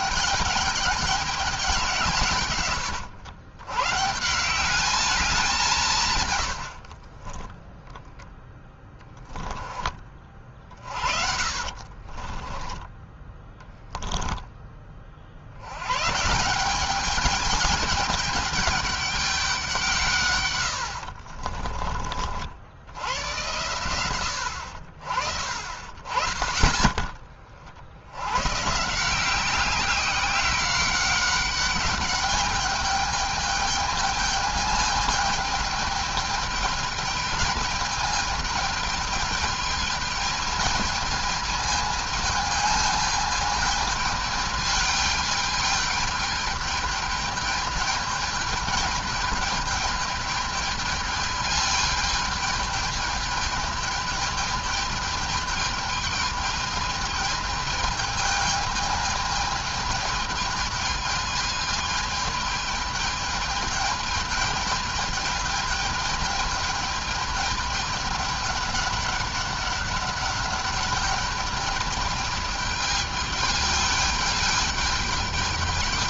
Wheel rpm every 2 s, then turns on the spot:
210, 140, 190, 100, 10, 40, 20, 20, 180, 200, 100, 80, 60, 20, 140, 190, 210, 210, 210, 210, 220, 220, 210, 210, 210, 220, 210, 210, 220, 210, 210, 210, 210, 210, 200, 210, 210, 210.
6-14 20-22